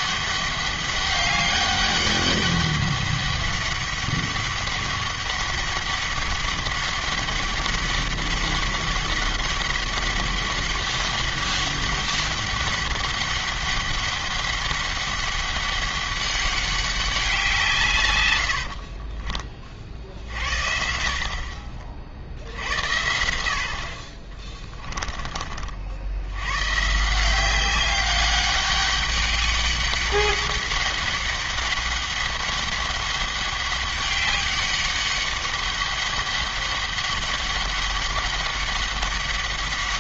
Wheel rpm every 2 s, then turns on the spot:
200, 200, 200, 200, 200, 200, 200, 200, 200, 50, 60, 80, 20, 130, 200, 200, 200, 200, 200, 200.
18-20